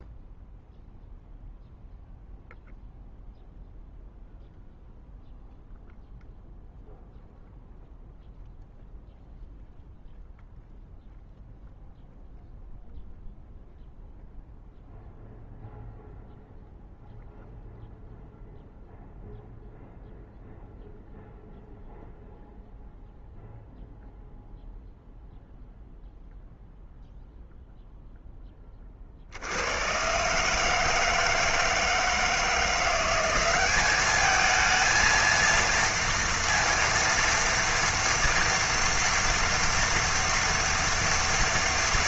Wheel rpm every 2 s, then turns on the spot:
0, 0, 0, 0, 0, 0, 0, 0, 0, 0, 0, 0, 0, 0, 20, 150, 170, 220, 230, 230, 230.
none